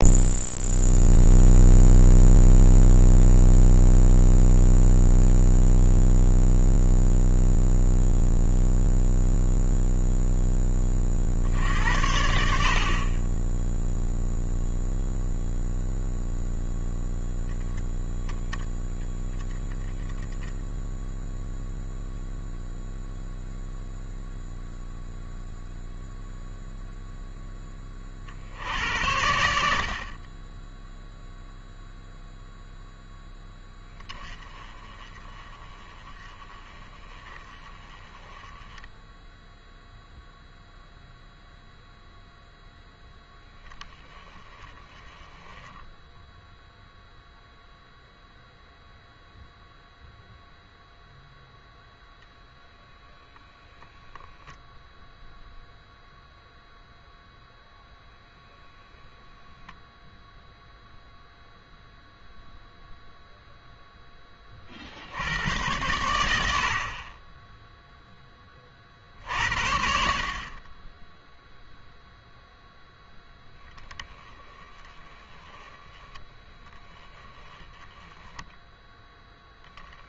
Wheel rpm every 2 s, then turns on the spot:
0, 0, 0, 0, 0, 10, 60, 0, 0, 0, 10, 0, 0, 0, 70, 0, 0, 20, 20, 10, 0, 0, 20, 0, 0, 0, 0, 0, 0, 0, 0, 0, 30, 80, 40, 10, 0, 20, 10, 0.
none